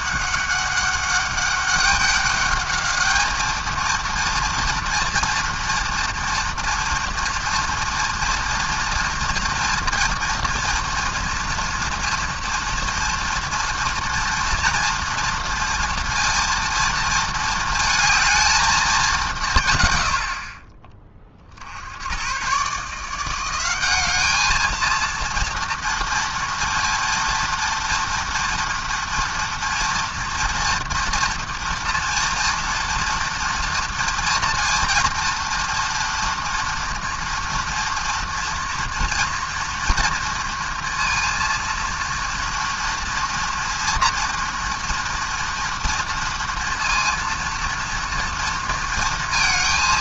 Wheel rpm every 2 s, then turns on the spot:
200, 210, 230, 230, 230, 230, 230, 230, 230, 210, 30, 150, 220, 230, 230, 230, 230, 230, 230, 230, 230, 230, 240, 230, 230.
none